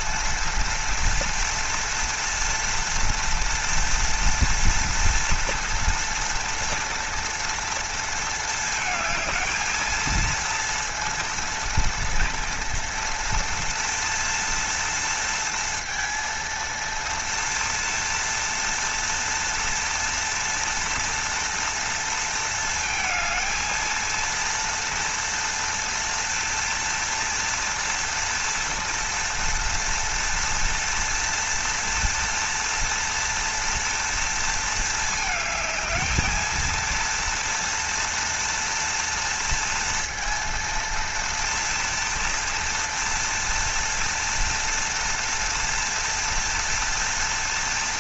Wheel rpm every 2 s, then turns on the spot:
230, 230, 230, 230, 220, 230, 230, 230, 230, 230, 230, 230, 230, 230, 230, 240, 230, 230, 230, 230, 230, 230, 230, 230.
none